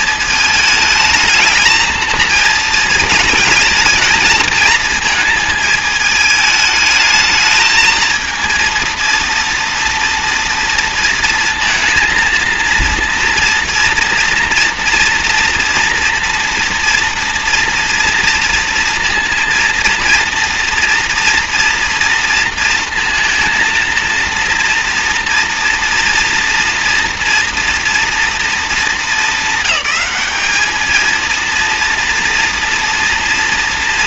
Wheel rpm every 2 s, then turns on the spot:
220, 220, 220, 220, 230, 230, 230, 230, 230, 230, 230, 230, 230, 230, 220, 220, 230.
none